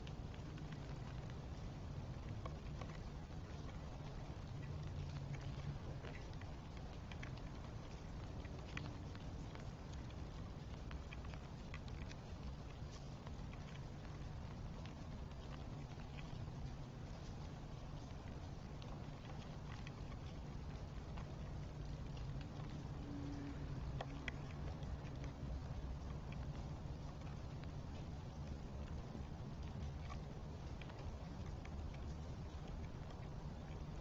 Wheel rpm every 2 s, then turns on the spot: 0, 0, 0, 0, 0, 0, 0, 0, 0, 0, 0, 0, 0, 0, 0, 0, 0.
none